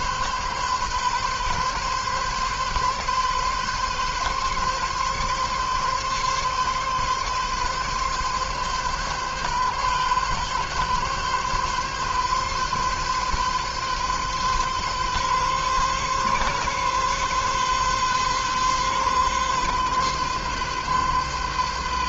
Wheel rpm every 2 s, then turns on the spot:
140, 140, 140, 140, 130, 130, 140, 140, 130, 130, 130.
none